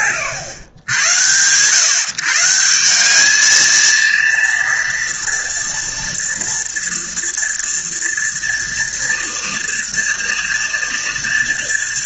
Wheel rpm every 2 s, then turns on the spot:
110, 180, 230, 230, 230, 230.
none